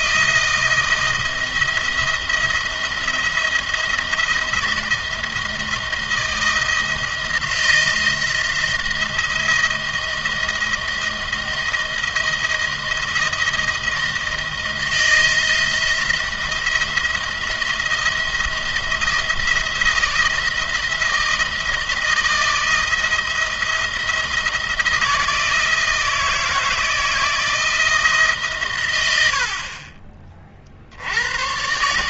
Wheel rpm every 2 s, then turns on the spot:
170, 170, 170, 170, 170, 160, 160, 160, 170, 170, 160, 160, 170, 160, 110, 60.
none